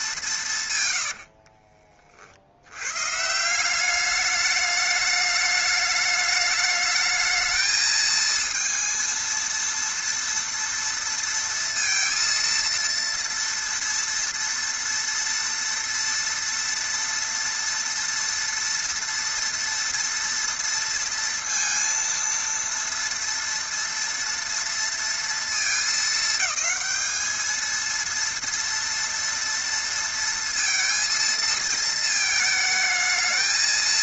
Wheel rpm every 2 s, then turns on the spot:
150, 80, 210, 210, 230, 230, 230, 230, 230, 230, 230, 230, 230, 210, 230, 230, 220.
none